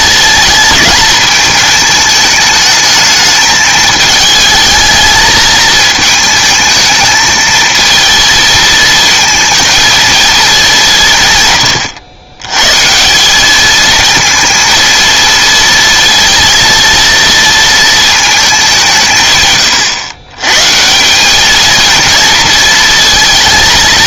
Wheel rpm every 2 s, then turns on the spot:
220, 210, 220, 220, 230, 210, 130, 230, 230, 200, 150, 220.
none